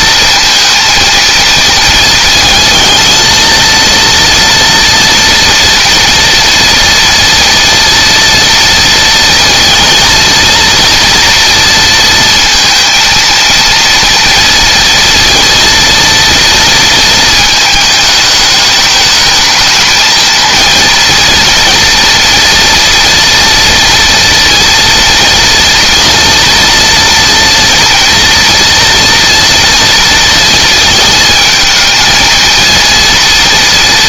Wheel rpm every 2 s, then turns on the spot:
230, 230, 230, 230, 230, 230, 230, 230, 230, 210, 230, 230, 230, 230, 240, 230, 230.
none